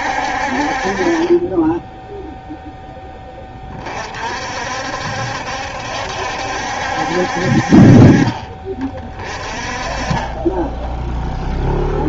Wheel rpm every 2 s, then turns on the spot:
40, 10, 60, 70, 30, 10.
none